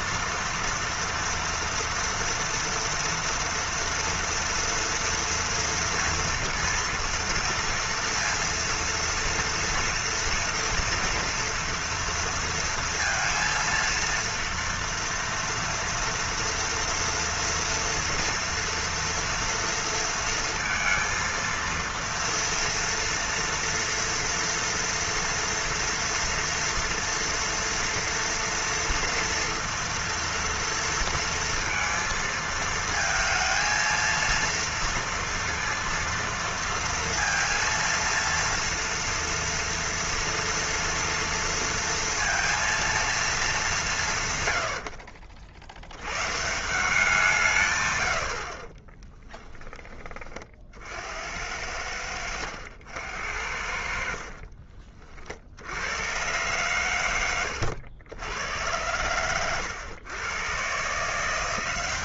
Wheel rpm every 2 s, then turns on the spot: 230, 230, 240, 230, 230, 230, 230, 230, 230, 230, 230, 230, 230, 230, 230, 230, 220, 230, 230, 230, 230, 230, 130, 140, 70, 30, 80, 50, 110, 90, 120.
54-56